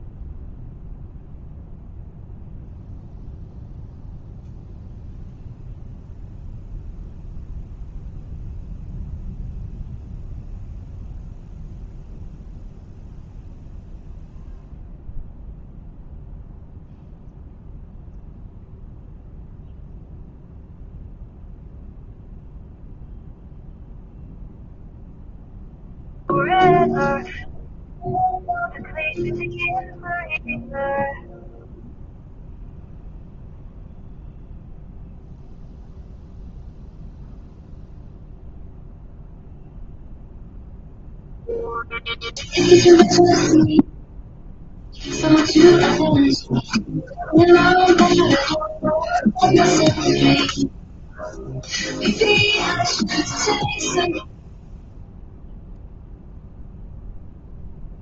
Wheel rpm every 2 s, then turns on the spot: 0, 0, 0, 0, 0, 0, 0, 0, 0, 0, 0, 0, 0, 0, 0, 0, 0, 0, 0, 0, 0, 0, 0, 0, 0, 0, 0, 0, 0.
none